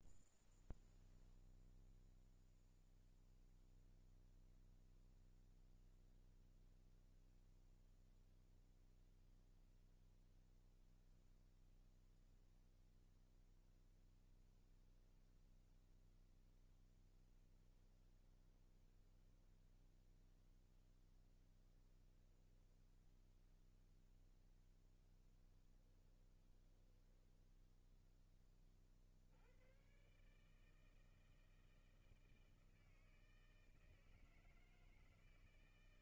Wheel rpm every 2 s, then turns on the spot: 0, 0, 0, 0, 0, 0, 0, 10, 0, 10, 0, 10, 0, 10, 20, 140, 160, 160.
18-20 22-24 26-28